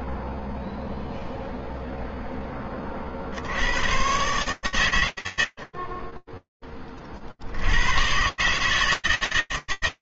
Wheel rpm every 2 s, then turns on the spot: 0, 40, 90, 0, 130.
none